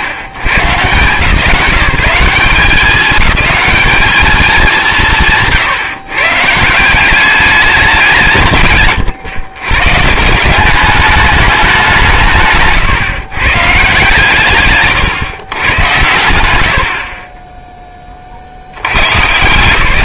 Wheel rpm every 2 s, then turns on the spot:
140, 190, 190, 170, 140, 190, 140, 130, 120, 80.
12-14